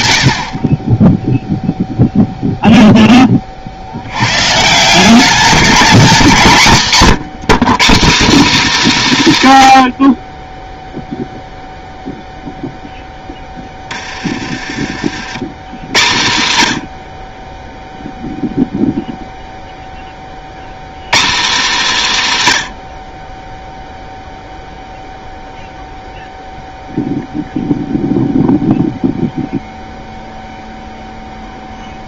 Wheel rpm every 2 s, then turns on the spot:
30, 10, 170, 160, 260, 0, 10, 80, 80, 0, 160, 70, 0, 0, 0, 0.
12-14